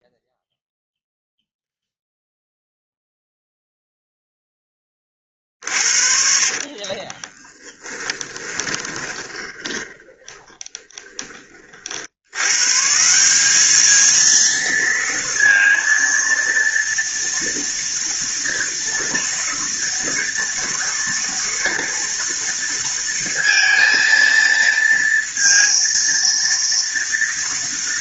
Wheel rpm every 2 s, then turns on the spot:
0, 0, 30, 30, 20, 20, 160, 230, 230, 230, 230, 230, 230, 230.
6-12